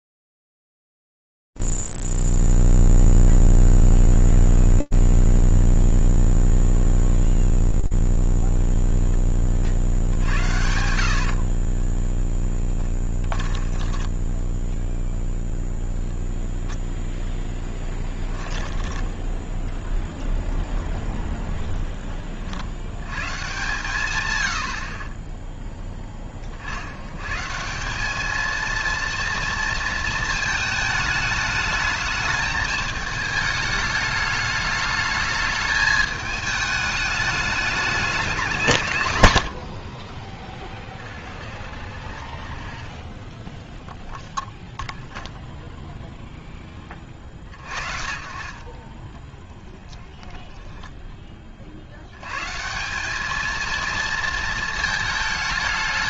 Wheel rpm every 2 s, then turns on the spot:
0, 0, 0, 0, 10, 60, 20, 0, 10, 10, 0, 140, 10, 180, 220, 210, 210, 220, 200, 30, 20, 0, 30, 20, 20, 210, 220, 220.
10-14